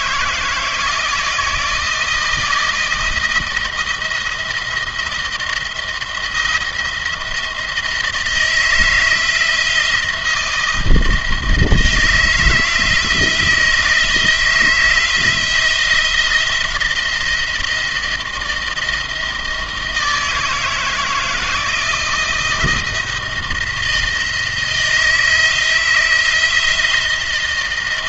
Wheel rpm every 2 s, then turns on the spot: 160, 170, 170, 170, 160, 160, 160, 160, 170, 160, 160, 160, 160, 160.
none